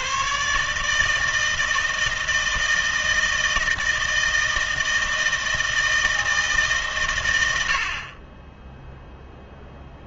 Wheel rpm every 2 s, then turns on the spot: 150, 160, 160, 140, 10.
none